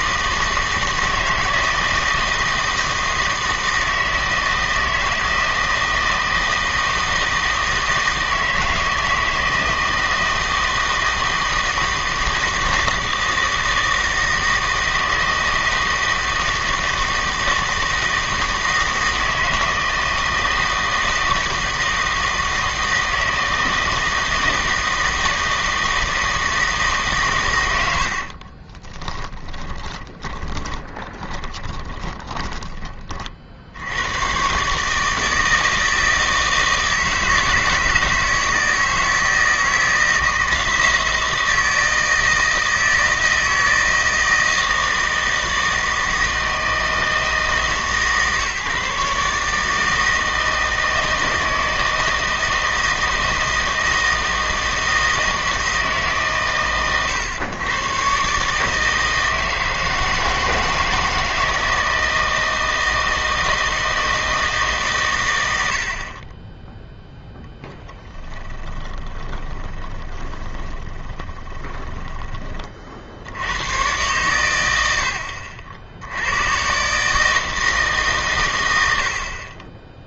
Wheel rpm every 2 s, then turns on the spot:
160, 160, 160, 160, 160, 160, 160, 160, 160, 160, 160, 160, 160, 160, 40, 20, 30, 150, 160, 160, 160, 160, 160, 160, 140, 160, 160, 160, 130, 150, 160, 160, 160, 10, 30, 20, 30, 100, 120, 110.
28-32 68-72